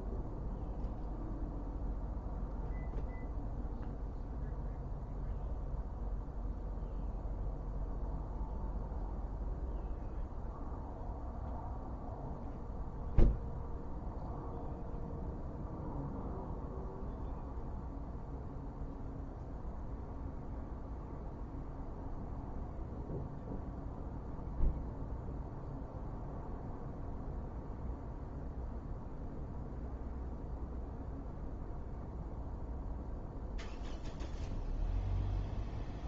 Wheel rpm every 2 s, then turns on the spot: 0, 0, 0, 0, 0, 0, 0, 0, 0, 0, 0, 0, 0, 0, 0, 0, 0, 0.
none